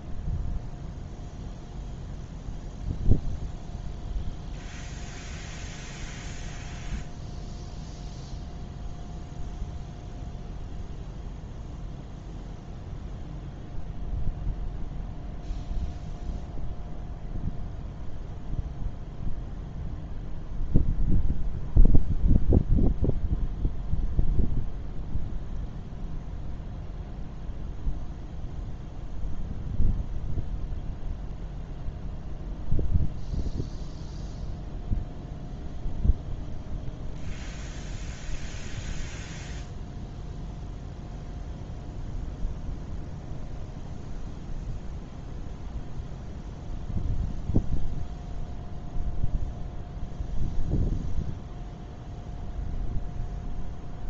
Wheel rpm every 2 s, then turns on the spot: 0, 0, 0, 0, 0, 0, 0, 0, 0, 0, 0, 0, 0, 0, 0, 0, 0, 0, 0, 0, 0, 0, 0, 0, 0, 0, 0.
none